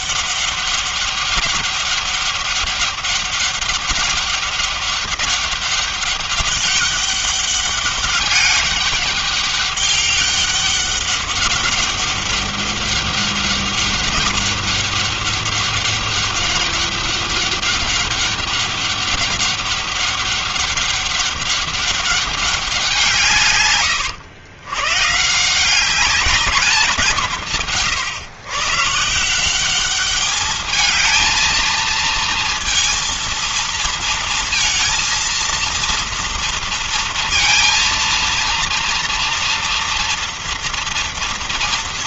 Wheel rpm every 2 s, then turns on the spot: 200, 200, 200, 200, 200, 200, 200, 200, 200, 200, 200, 190, 100, 210, 140, 210, 230, 230, 230, 230, 230.
none